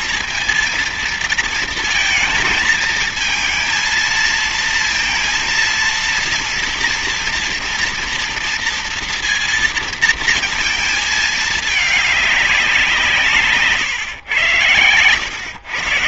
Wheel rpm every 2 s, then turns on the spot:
230, 220, 230, 230, 230, 220, 190, 120.
none